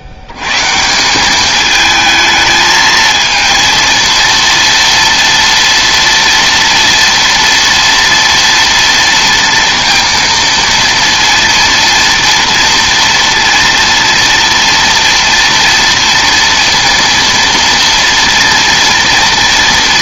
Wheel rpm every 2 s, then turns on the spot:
90, 220, 230, 230, 230, 230, 230, 230, 230, 230.
none